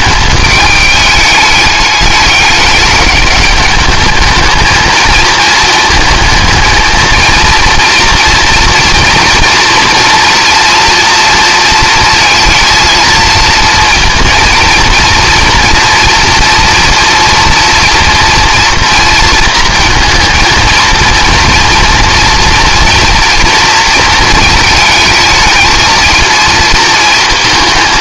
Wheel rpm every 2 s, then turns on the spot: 210, 210, 220, 220, 230, 230, 230, 230, 230, 240, 230, 240, 220, 230.
none